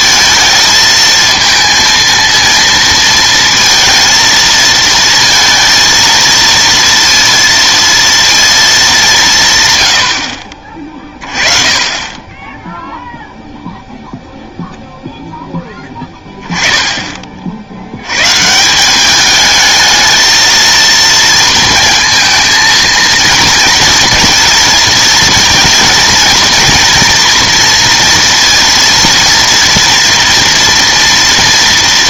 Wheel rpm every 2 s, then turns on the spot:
230, 230, 220, 230, 220, 50, 10, 0, 10, 160, 220, 220, 230, 230, 230, 230.
none